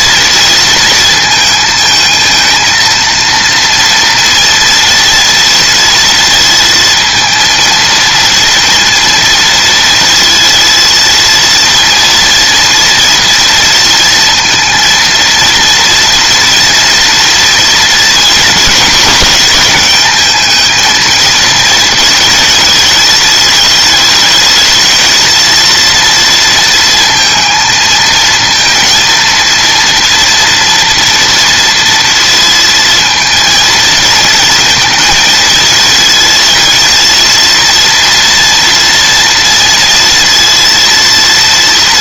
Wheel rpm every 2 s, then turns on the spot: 230, 230, 230, 230, 230, 230, 230, 230, 230, 220, 220, 220, 220, 230, 230, 230, 230, 230, 230, 230, 230.
none